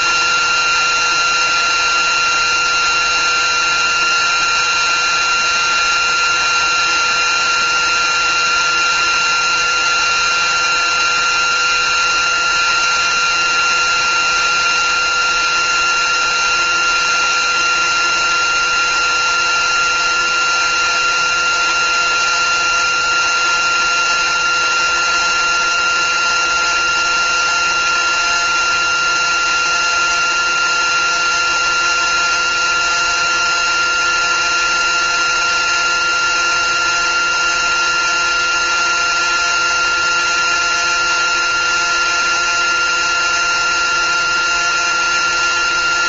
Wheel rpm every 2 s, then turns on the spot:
360, 360, 350, 360, 350, 360, 360, 360, 360, 360, 360, 360, 360, 360, 360, 360, 360, 360, 360, 360, 360, 360, 360.
none